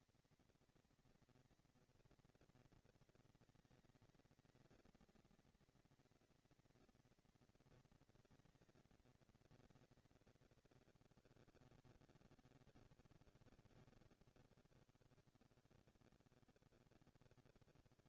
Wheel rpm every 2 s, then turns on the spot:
230, 230, 230, 230, 220, 220, 170, 160, 190.
none